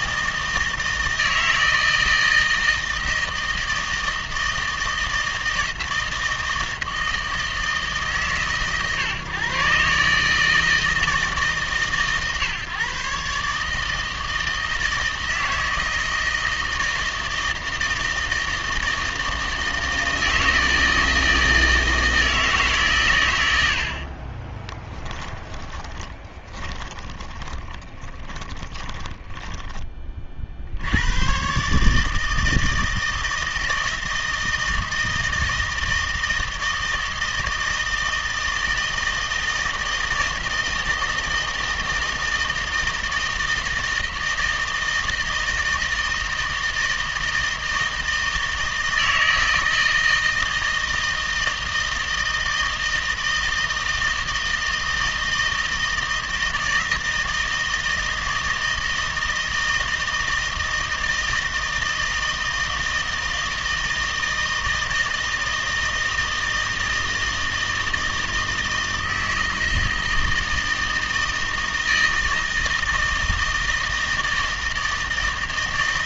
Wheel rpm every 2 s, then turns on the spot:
160, 160, 160, 160, 130, 160, 140, 160, 160, 160, 160, 140, 20, 30, 10, 80, 160, 160, 160, 160, 160, 160, 160, 160, 160, 160, 160, 160, 160, 160, 160, 160, 160, 160, 160, 160, 160, 160.
24-30